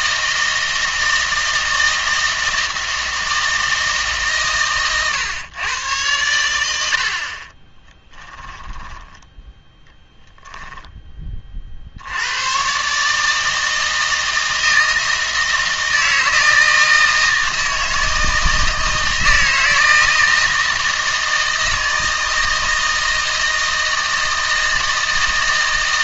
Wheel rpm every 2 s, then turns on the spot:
160, 160, 130, 80, 10, 10, 120, 160, 160, 160, 160, 160, 160.
8-12